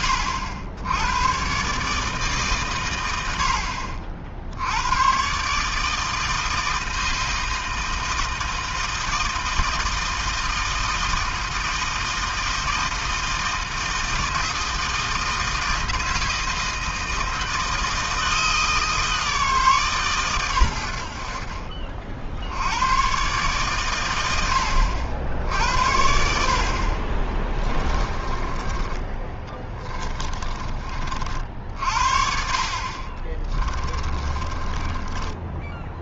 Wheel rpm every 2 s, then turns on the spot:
90, 140, 80, 160, 160, 160, 160, 160, 160, 160, 100, 100, 80, 60, 30, 30, 50, 20.
28-30 34-36